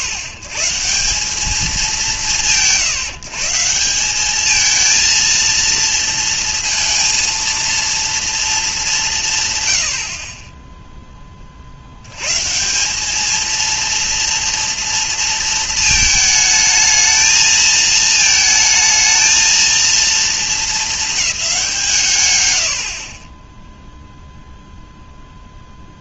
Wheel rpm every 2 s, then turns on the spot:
140, 130, 220, 230, 210, 10, 190, 230, 220, 220, 220, 40, 0.
none